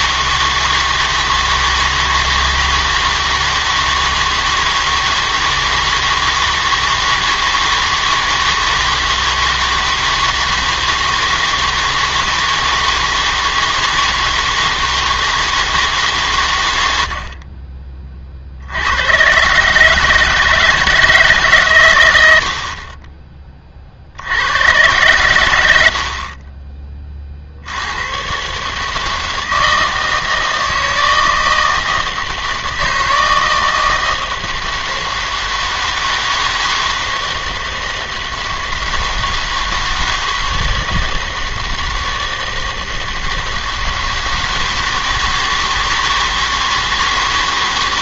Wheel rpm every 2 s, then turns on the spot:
160, 160, 160, 160, 160, 160, 160, 160, 100, 60, 160, 60, 100, 30, 140, 160, 160, 160, 160, 160, 160, 160, 160, 160.
none